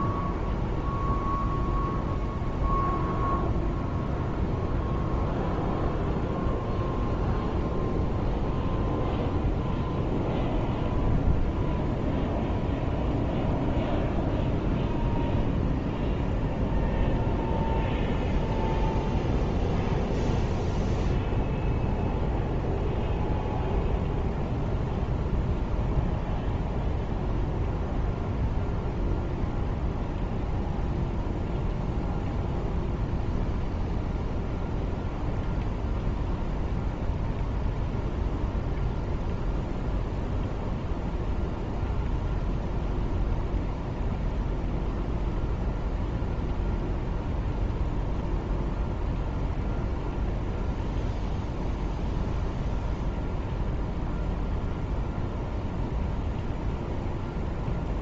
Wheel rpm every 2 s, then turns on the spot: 0, 0, 0, 0, 0, 0, 0, 0, 0, 0, 0, 0, 0, 0, 0, 0, 0, 0, 0, 0, 0, 0, 0, 0, 0, 0, 0, 0, 0.
none